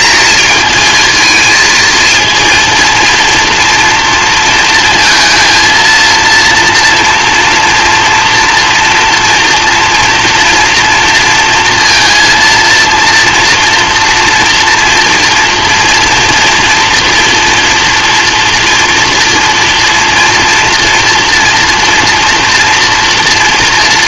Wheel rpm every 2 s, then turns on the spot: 220, 230, 230, 240, 230, 230, 230, 230, 230, 230, 230, 230.
none